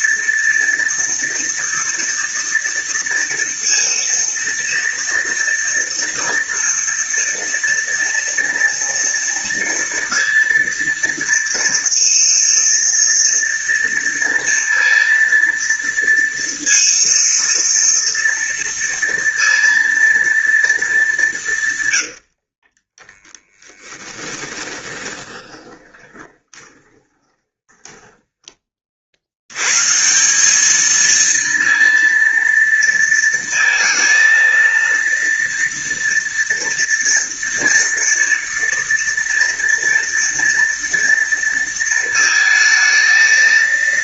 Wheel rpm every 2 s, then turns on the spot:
230, 230, 230, 230, 230, 230, 230, 230, 230, 230, 210, 20, 20, 20, 40, 220, 230, 230, 230, 230, 230, 220.
22-28